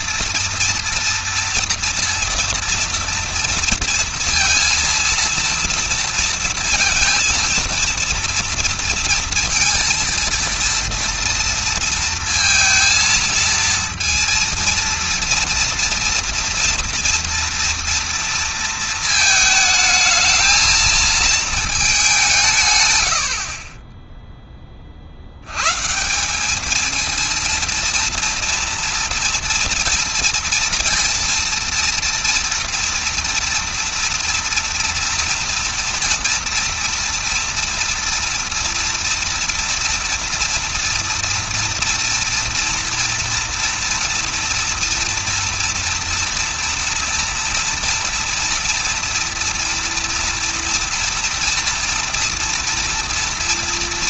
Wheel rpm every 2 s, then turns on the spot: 230, 230, 230, 230, 230, 230, 230, 230, 230, 230, 220, 140, 20, 210, 230, 230, 230, 230, 230, 230, 230, 230, 230, 230, 230, 230, 230.
none